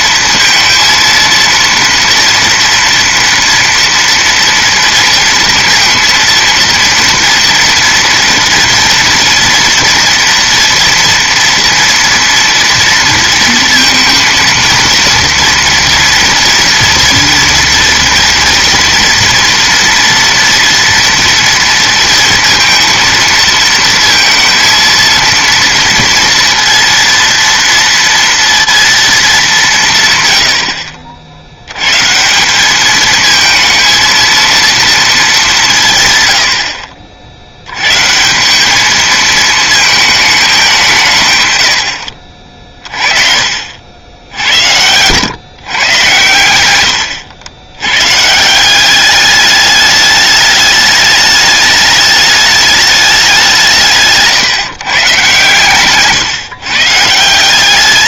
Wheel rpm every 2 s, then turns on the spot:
230, 230, 230, 230, 230, 230, 230, 230, 230, 230, 230, 230, 230, 230, 230, 60, 210, 220, 60, 200, 180, 30, 90, 100, 180, 210, 210, 130, 150.
none